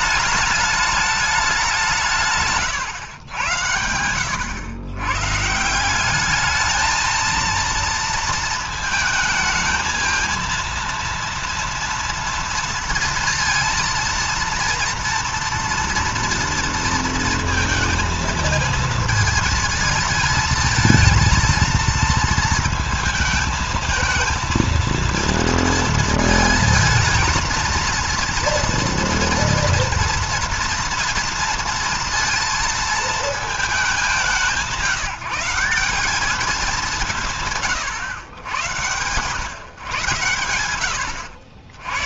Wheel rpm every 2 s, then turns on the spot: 210, 130, 90, 210, 220, 230, 230, 230, 230, 230, 220, 220, 230, 220, 230, 230, 230, 190, 200, 110, 110.
2-4